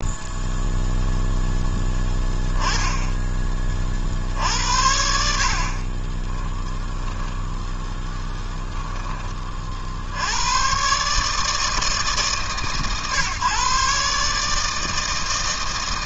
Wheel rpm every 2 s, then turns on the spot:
0, 10, 70, 10, 10, 130, 140, 160.
none